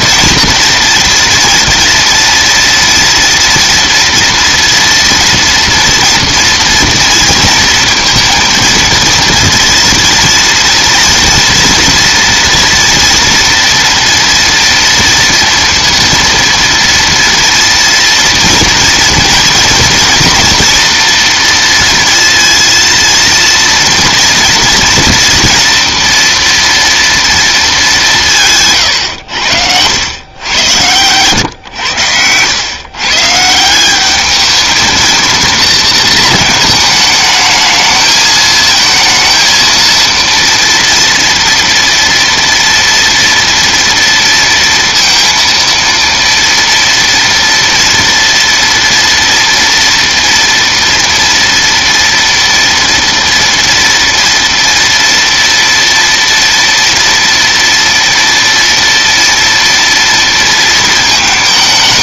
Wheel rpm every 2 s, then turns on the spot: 230, 230, 230, 230, 230, 230, 230, 230, 230, 230, 230, 230, 230, 230, 180, 100, 110, 210, 220, 220, 230, 230, 230, 230, 230, 230, 230, 230, 230, 230, 230.
none